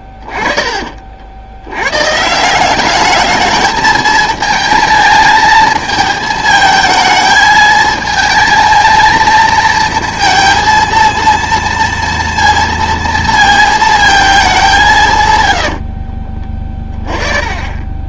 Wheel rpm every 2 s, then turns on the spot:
20, 180, 220, 220, 230, 230, 230, 190, 20.
16-18